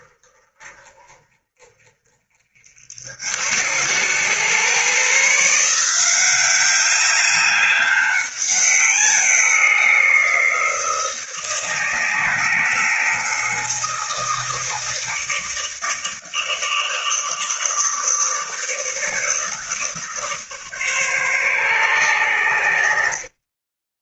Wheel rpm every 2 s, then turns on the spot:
40, 60, 130, 200, 190, 170, 160, 160, 150, 150, 140, 70.
none